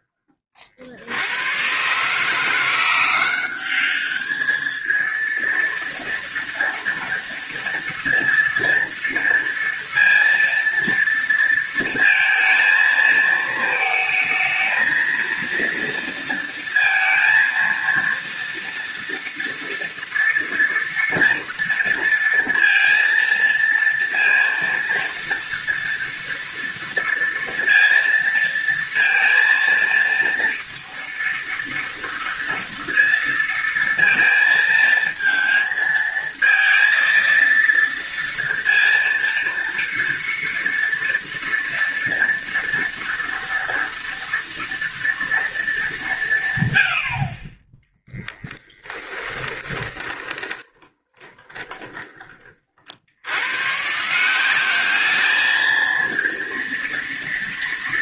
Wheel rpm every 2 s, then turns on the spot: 40, 170, 220, 230, 230, 230, 230, 230, 230, 230, 230, 230, 230, 230, 230, 230, 230, 230, 230, 230, 230, 230, 230, 80, 10, 20, 50, 200, 230.
48-52